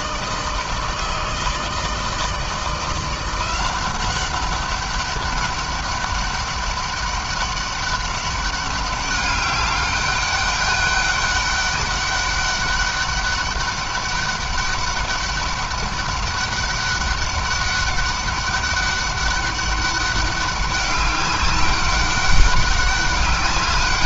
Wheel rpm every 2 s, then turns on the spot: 160, 170, 200, 200, 200, 200, 200, 200, 200, 200, 200, 200.
none